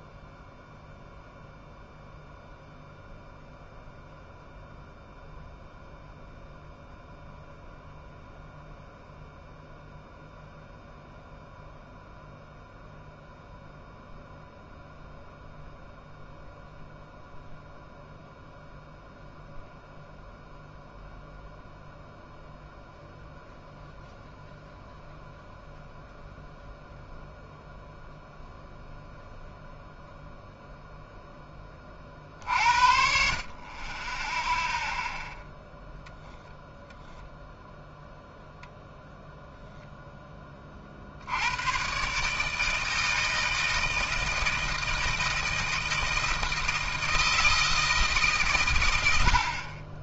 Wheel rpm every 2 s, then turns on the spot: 0, 0, 0, 0, 0, 0, 0, 0, 0, 0, 0, 0, 0, 0, 0, 0, 50, 0, 0, 0, 30, 160, 160, 160, 110.
none